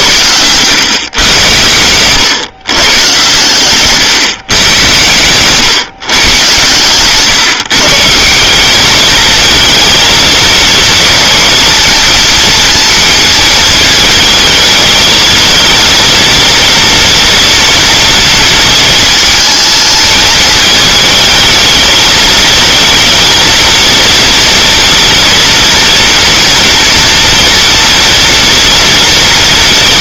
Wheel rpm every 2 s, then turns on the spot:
120, 130, 110, 130, 200, 230, 230, 220, 230, 220, 220, 220, 230, 230, 230.
none